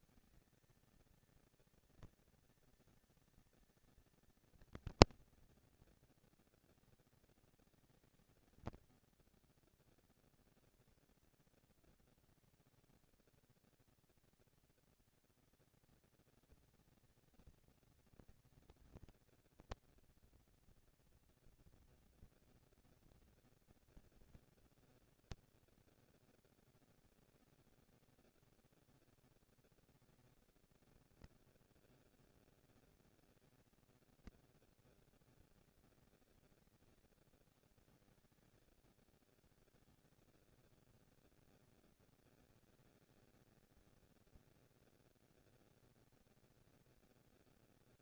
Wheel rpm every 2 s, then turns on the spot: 230, 230, 230, 240, 230, 230, 230, 230, 230, 230, 240, 230, 220, 230, 230, 230, 220, 210, 170, 120, 190, 230, 230, 230.
none